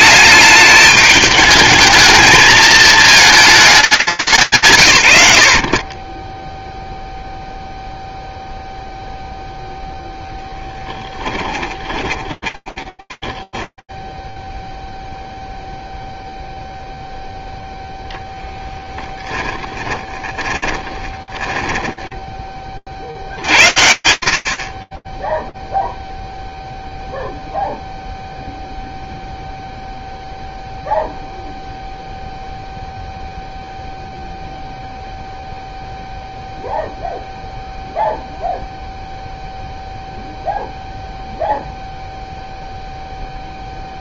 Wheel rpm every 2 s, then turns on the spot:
210, 220, 140, 0, 0, 10, 10, 0, 0, 10, 20, 60, 0, 0, 0, 0, 0, 0, 0, 0, 0, 0.
10-14 18-22